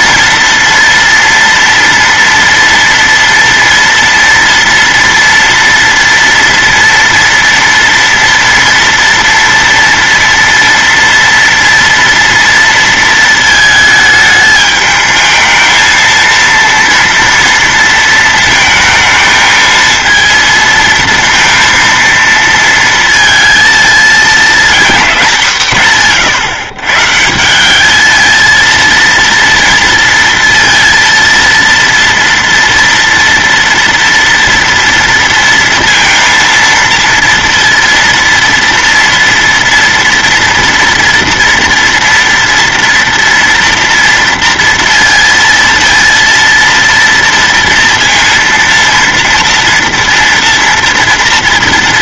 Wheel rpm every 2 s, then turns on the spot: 230, 230, 230, 230, 230, 230, 230, 220, 230, 220, 230, 230, 220, 140, 230, 230, 230, 230, 230, 230, 230, 240, 230, 230, 230, 230.
none